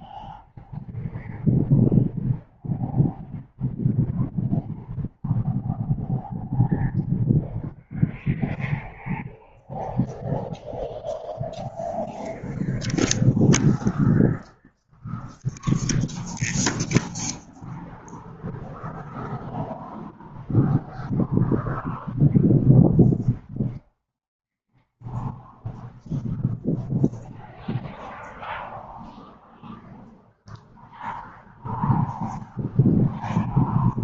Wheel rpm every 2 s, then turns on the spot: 0, 0, 0, 0, 0, 0, 0, 0, 0, 0, 0, 0, 0, 0, 0, 0, 0.
none